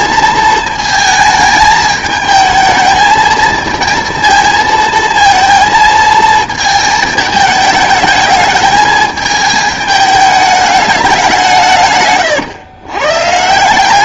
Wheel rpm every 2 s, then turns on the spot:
220, 220, 220, 220, 210, 210, 120.
none